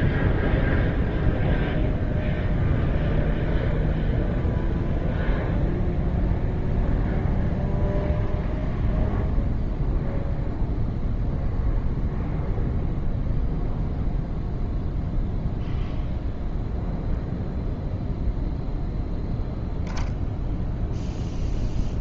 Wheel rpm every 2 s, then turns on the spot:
0, 0, 0, 0, 0, 0, 0, 0, 0, 0, 0.
none